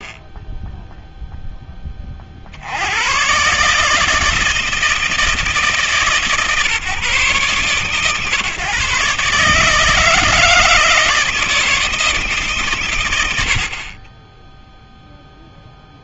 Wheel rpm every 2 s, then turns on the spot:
0, 60, 160, 140, 130, 160, 140, 10.
none